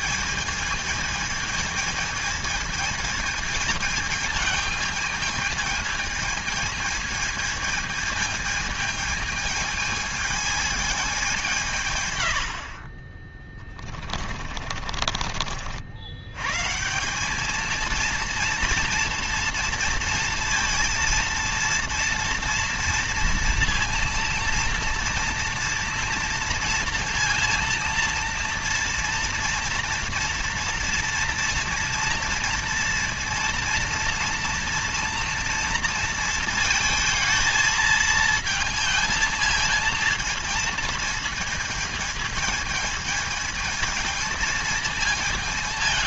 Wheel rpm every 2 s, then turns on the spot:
220, 220, 220, 220, 220, 220, 80, 30, 130, 230, 230, 230, 230, 230, 230, 230, 230, 230, 230, 220, 230, 220, 220.
14-16